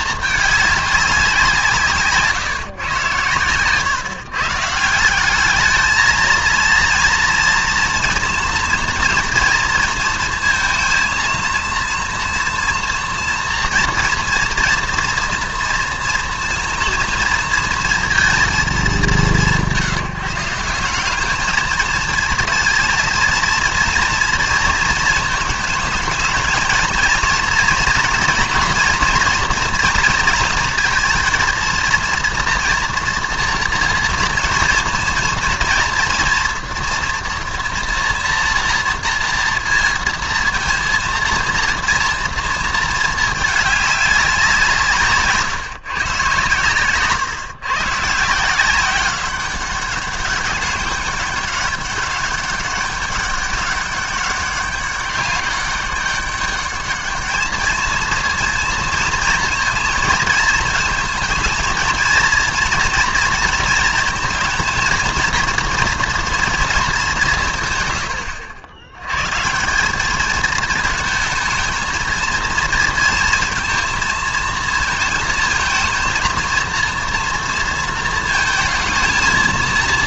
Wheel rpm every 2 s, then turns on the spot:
210, 130, 150, 230, 230, 230, 230, 240, 230, 210, 180, 220, 230, 220, 240, 230, 230, 230, 230, 230, 230, 220, 170, 130, 180, 200, 200, 200, 200, 230, 220, 230, 230, 220, 80, 220, 230, 230, 230, 230.
none